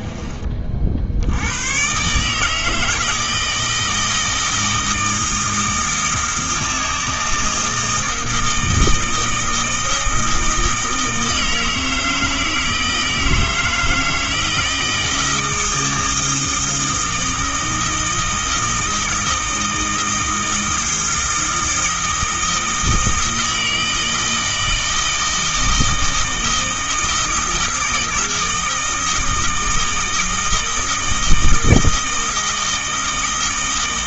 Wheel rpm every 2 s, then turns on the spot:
70, 160, 160, 160, 160, 160, 160, 160, 160, 160, 160, 160, 160, 160, 160, 160, 160.
none